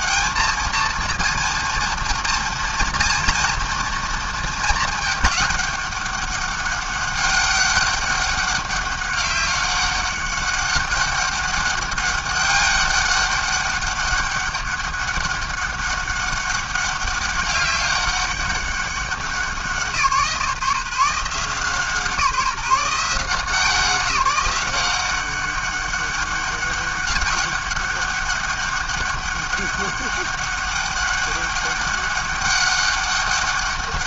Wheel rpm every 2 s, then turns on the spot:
220, 230, 220, 200, 200, 200, 200, 200, 200, 190, 160, 170, 190, 200, 200, 200, 200.
none